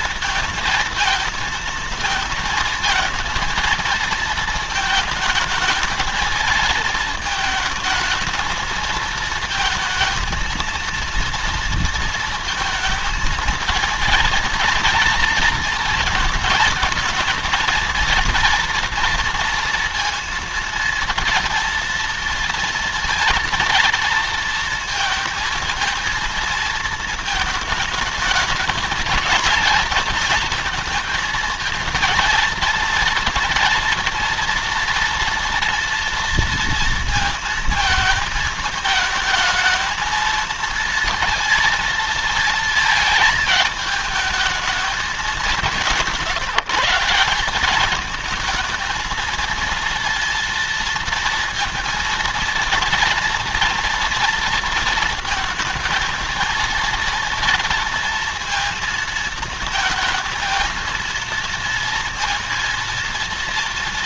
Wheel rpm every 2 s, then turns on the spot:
230, 230, 220, 220, 230, 230, 220, 230, 230, 230, 230, 230, 230, 230, 220, 230, 230, 230, 230, 220, 230, 220, 210, 160, 230, 230, 230, 230, 230, 230, 230, 230.
none